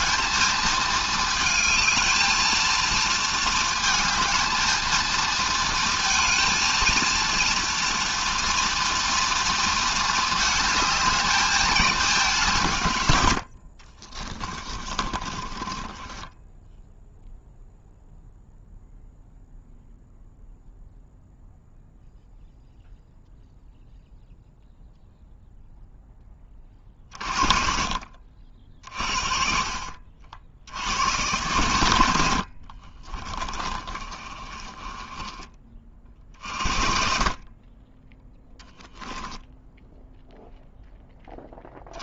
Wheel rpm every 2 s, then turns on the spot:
220, 230, 220, 230, 230, 210, 120, 30, 0, 0, 0, 0, 0, 40, 40, 90, 30, 20, 30, 10, 10.
14-16 32-36